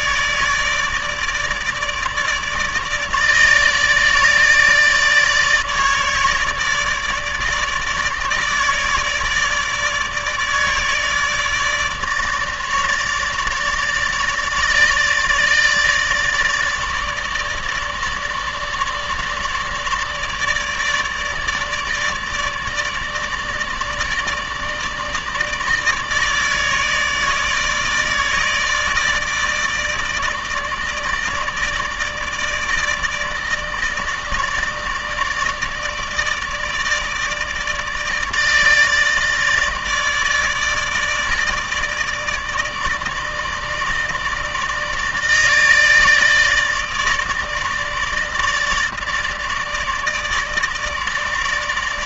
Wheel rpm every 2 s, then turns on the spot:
150, 150, 150, 150, 150, 150, 150, 150, 150, 150, 150, 150, 160, 150, 150, 150, 160, 160, 150, 160, 160, 160, 160, 150, 150, 160.
none